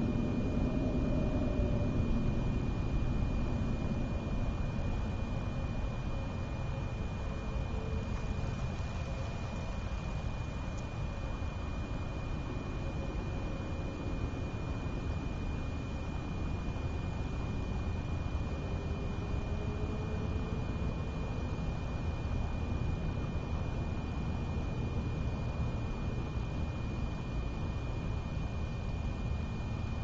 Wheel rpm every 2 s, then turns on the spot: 0, 0, 0, 0, 0, 0, 0, 0, 0, 0, 0, 0, 0, 0, 0.
none